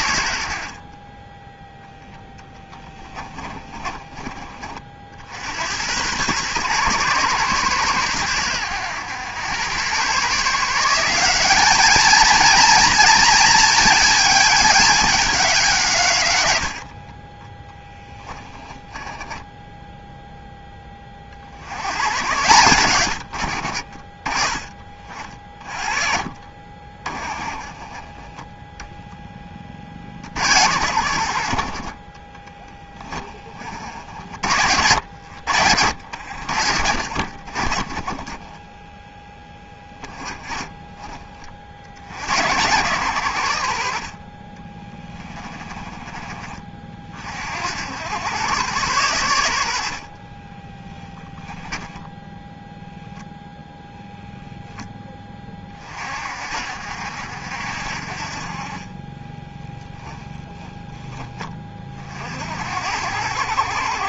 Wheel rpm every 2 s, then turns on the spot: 50, 10, 40, 130, 90, 160, 230, 210, 80, 10, 10, 110, 20, 30, 0, 80, 20, 70, 50, 20, 20, 90, 30, 30, 110, 20, 0, 10, 50, 40, 10, 70.
2-4 16-20 32-34 38-42 44-46 50-52 60-62